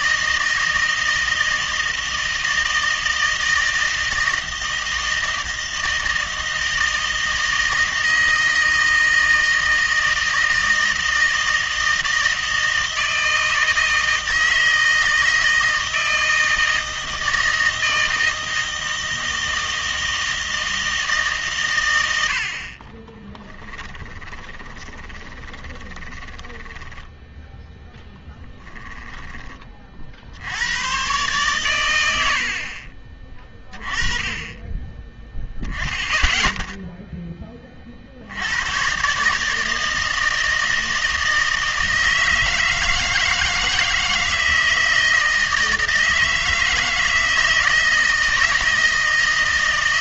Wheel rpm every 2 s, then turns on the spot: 160, 160, 160, 160, 160, 160, 160, 160, 160, 160, 160, 60, 20, 10, 10, 80, 60, 20, 0, 90, 160, 160, 160, 160, 160.
24-30